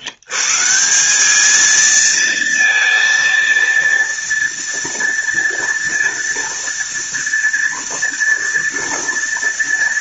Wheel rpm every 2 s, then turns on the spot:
160, 230, 230, 230, 230.
none